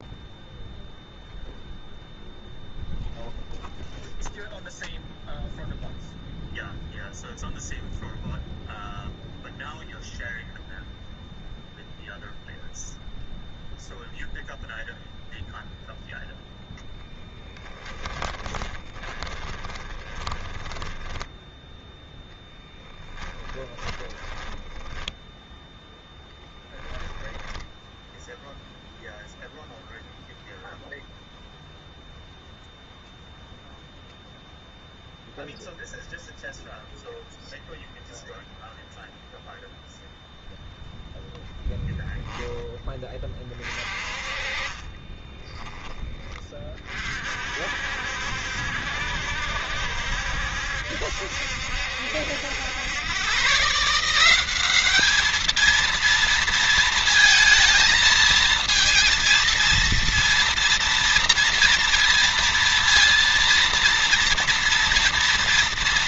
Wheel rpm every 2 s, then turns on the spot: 0, 0, 0, 0, 0, 0, 0, 0, 10, 20, 10, 20, 10, 10, 0, 0, 0, 0, 0, 0, 0, 10, 30, 40, 60, 70, 100, 200, 230, 230, 240, 230, 230.
16-28 44-46